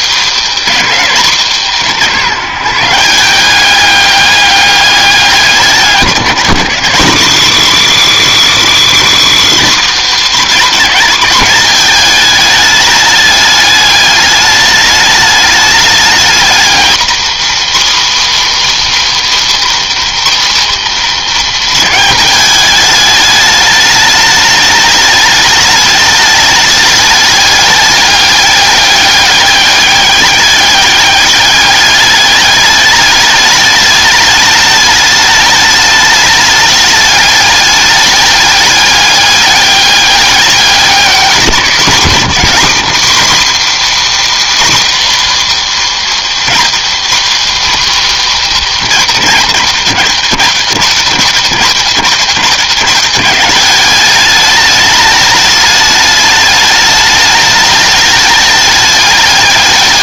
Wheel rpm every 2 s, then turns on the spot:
230, 160, 200, 180, 240, 230, 210, 210, 220, 280, 230, 210, 210, 210, 200, 200, 210, 210, 210, 200, 200, 230, 290, 250, 230, 190, 200, 210, 210, 210.
none